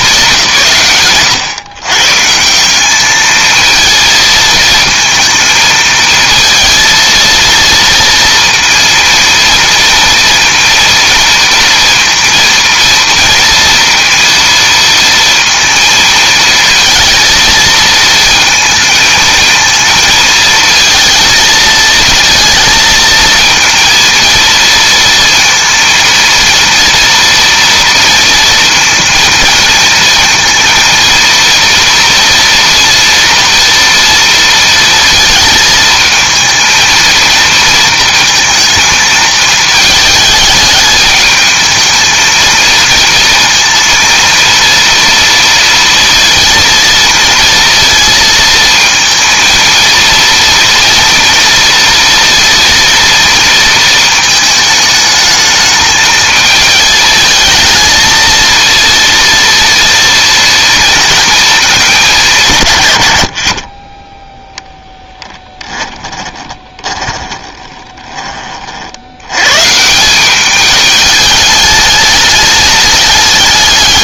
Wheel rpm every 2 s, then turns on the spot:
150, 190, 220, 220, 230, 230, 230, 230, 230, 220, 230, 230, 230, 230, 230, 230, 230, 230, 220, 220, 210, 220, 230, 230, 230, 230, 230, 220, 220, 230, 230, 130, 10, 20, 50, 210, 210.
66-68